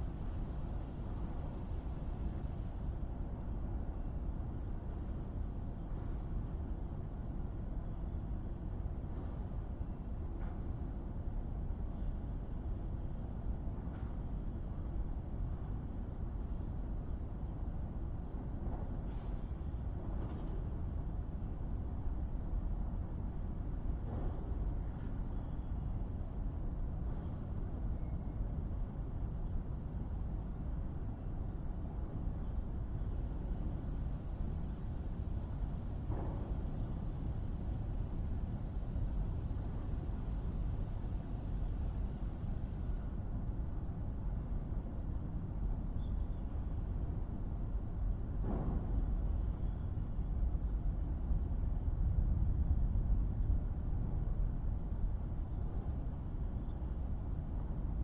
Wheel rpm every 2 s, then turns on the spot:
0, 0, 0, 0, 0, 0, 0, 0, 0, 0, 0, 0, 0, 0, 0, 0, 0, 0, 0, 0, 0, 0, 0, 0, 0, 0, 0, 0, 0.
none